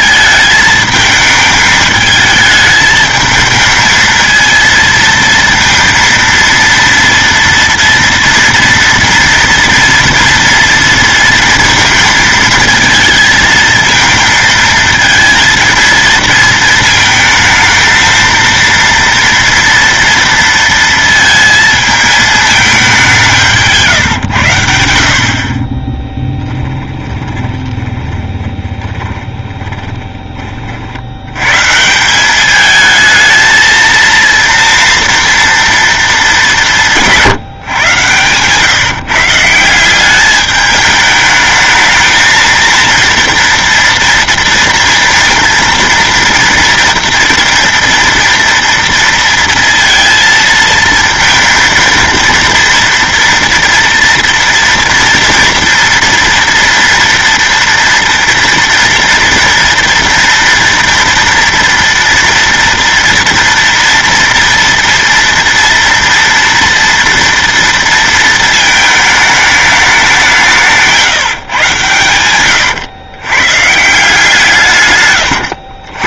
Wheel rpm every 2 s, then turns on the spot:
220, 220, 230, 230, 230, 230, 230, 220, 230, 230, 230, 210, 90, 20, 20, 30, 210, 230, 200, 130, 210, 220, 230, 230, 230, 230, 230, 230, 230, 230, 230, 230, 230, 230, 220, 170, 120, 160.
26-30 72-74